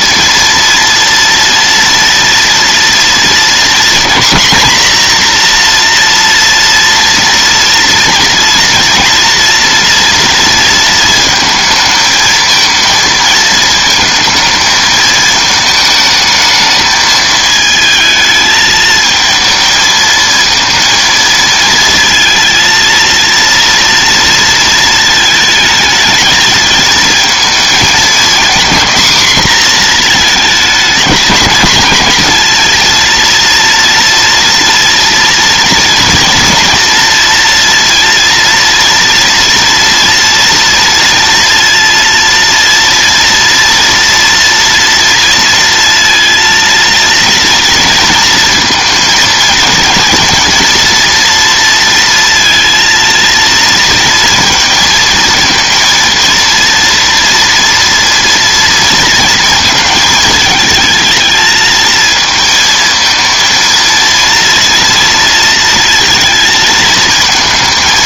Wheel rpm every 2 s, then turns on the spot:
230, 230, 240, 230, 230, 230, 230, 220, 220, 220, 220, 230, 230, 220, 250, 220, 230, 230, 230, 230, 230, 230, 230, 230, 220, 230, 230, 230, 230, 230, 220, 220, 230, 230.
none